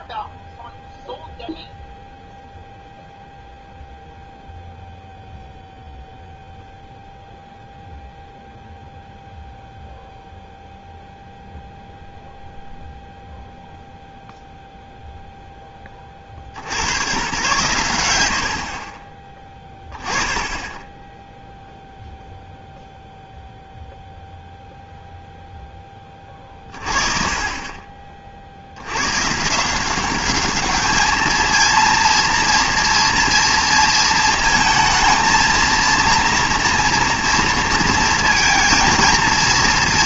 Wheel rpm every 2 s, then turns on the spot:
0, 0, 0, 0, 0, 0, 0, 0, 100, 40, 10, 0, 0, 40, 80, 210, 230, 220, 240, 230.
none